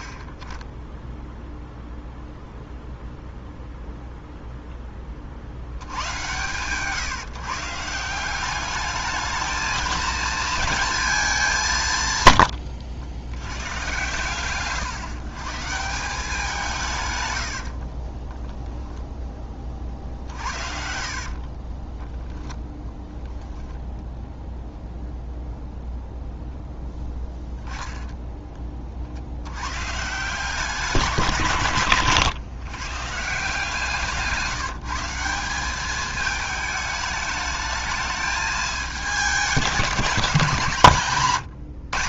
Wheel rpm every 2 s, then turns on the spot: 0, 0, 20, 150, 210, 210, 80, 130, 140, 0, 50, 0, 0, 20, 50, 180, 140, 170, 210, 210, 140.
20-22